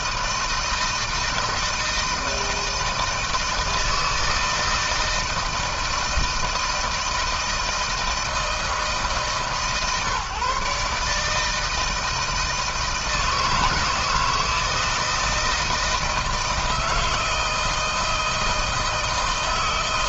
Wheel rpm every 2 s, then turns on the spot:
160, 160, 160, 160, 150, 140, 160, 160, 160, 160.
none